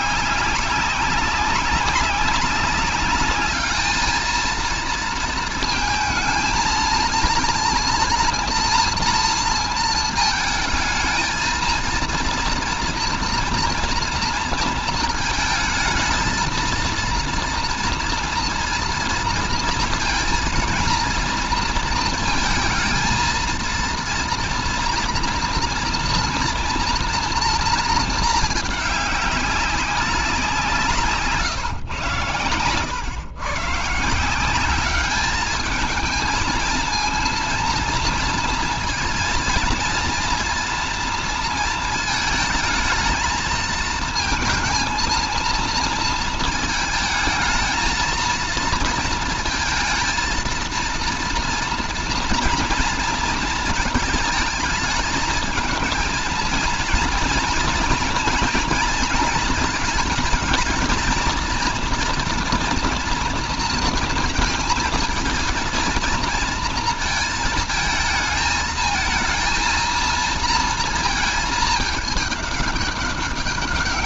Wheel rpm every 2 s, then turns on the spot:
200, 200, 230, 230, 230, 220, 230, 230, 230, 230, 230, 230, 230, 240, 210, 170, 110, 200, 230, 230, 230, 220, 220, 220, 230, 230, 240, 220, 230, 230, 220, 230, 220, 230, 220, 220, 200.
none